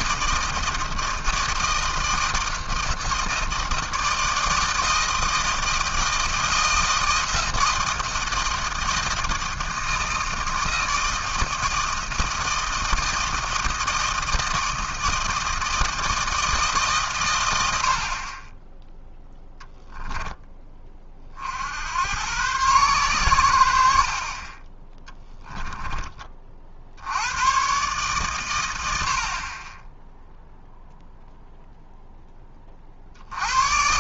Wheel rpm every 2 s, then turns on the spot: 160, 160, 160, 160, 160, 160, 160, 160, 150, 10, 20, 120, 20, 60, 110, 0, 30.
none